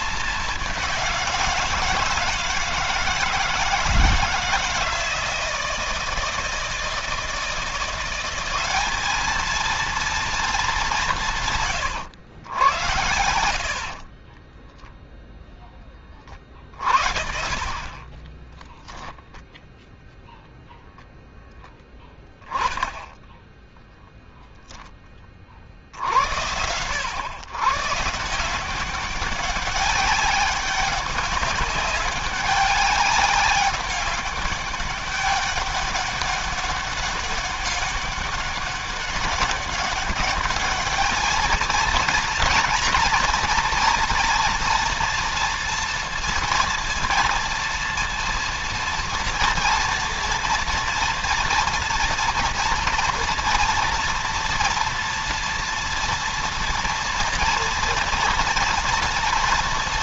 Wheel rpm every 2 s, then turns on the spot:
190, 160, 160, 160, 200, 190, 90, 10, 40, 0, 0, 20, 10, 90, 180, 200, 200, 200, 200, 200, 210, 230, 230, 230, 230, 230, 230, 230, 240, 240.
none